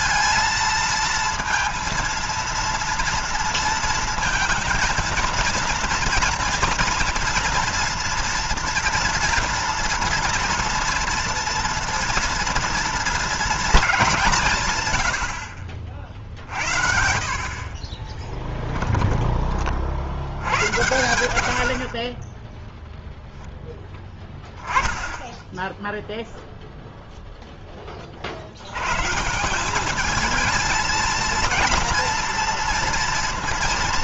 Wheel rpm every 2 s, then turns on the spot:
230, 230, 230, 230, 240, 230, 240, 140, 70, 10, 90, 10, 10, 0, 100, 220, 230.
18-20 22-24